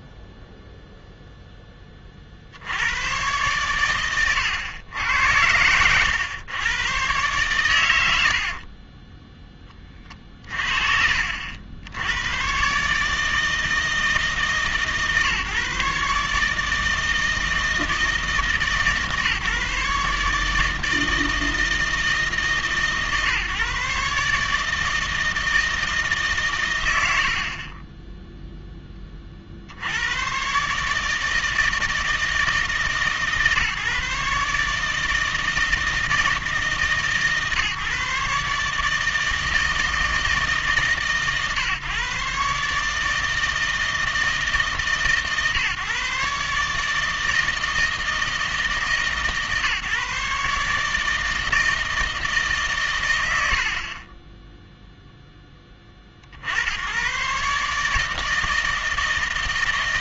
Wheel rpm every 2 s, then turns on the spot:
0, 50, 100, 100, 60, 50, 130, 150, 150, 150, 150, 150, 160, 110, 10, 140, 150, 150, 160, 150, 150, 150, 160, 150, 160, 150, 140, 0, 90, 160.
8-10 26-28